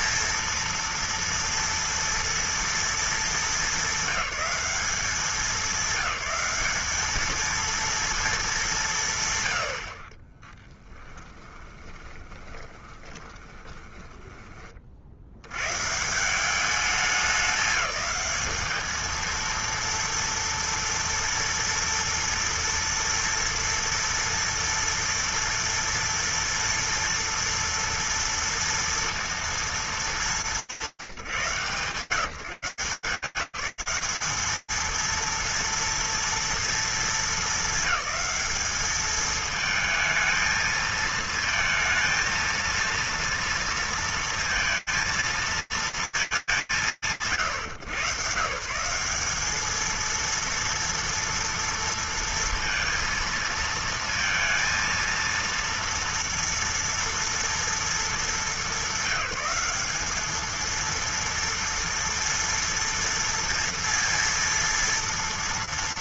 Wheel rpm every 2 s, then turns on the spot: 230, 230, 200, 190, 230, 40, 20, 20, 160, 210, 230, 230, 230, 230, 230, 210, 160, 210, 230, 210, 220, 230, 230, 180, 150, 230, 230, 230, 230, 210, 220, 230, 230.
10-16